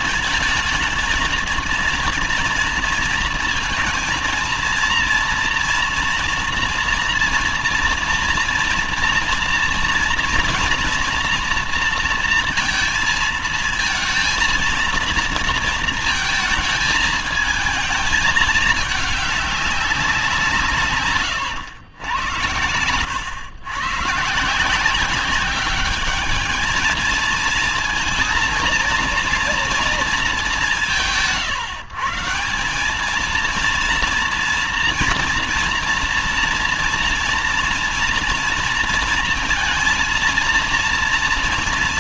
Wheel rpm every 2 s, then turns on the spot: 220, 230, 230, 230, 230, 230, 230, 230, 220, 220, 160, 110, 160, 220, 230, 190, 190, 230, 230, 230, 230.
none